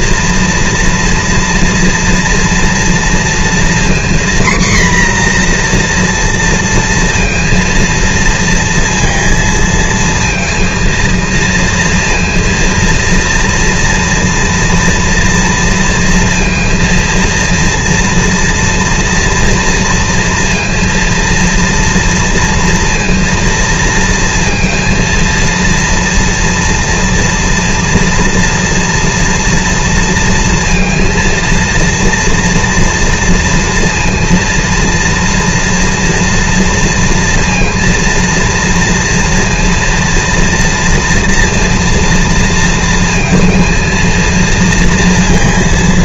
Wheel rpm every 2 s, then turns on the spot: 230, 230, 260, 240, 230, 230, 230, 230, 230, 230, 230, 230, 230, 230, 230, 230, 230, 230, 230, 230, 230, 230, 230.
none